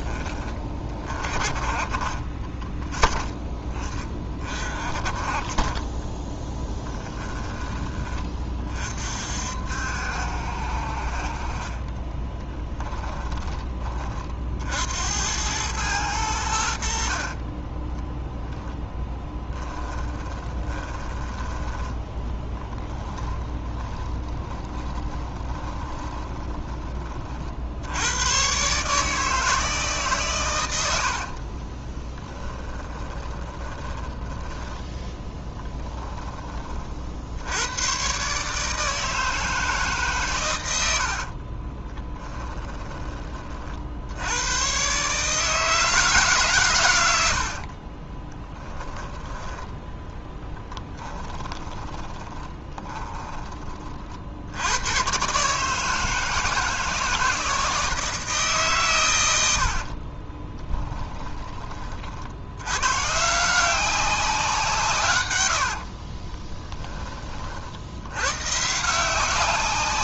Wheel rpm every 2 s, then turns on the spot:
20, 20, 30, 10, 40, 50, 10, 70, 80, 0, 20, 20, 20, 30, 140, 80, 20, 10, 50, 150, 90, 10, 120, 110, 10, 10, 20, 100, 160, 130, 10, 120, 160, 20, 160.
12-14 20-26 30-34 40-42 50-54 60-62